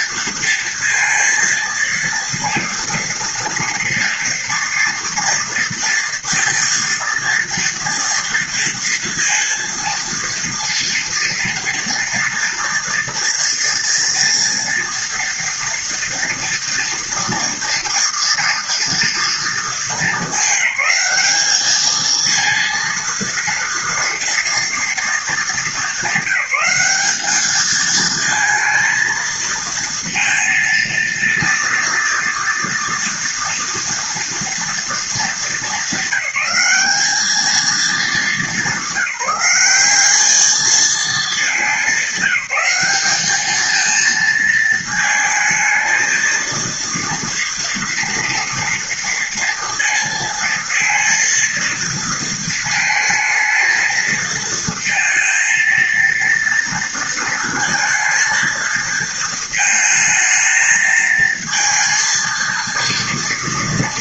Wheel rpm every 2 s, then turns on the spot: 230, 230, 230, 230, 230, 230, 230, 230, 230, 230, 210, 220, 230, 200, 220, 230, 230, 230, 190, 210, 210, 200, 220, 230, 230, 230, 230, 220, 230, 230, 220, 230.
none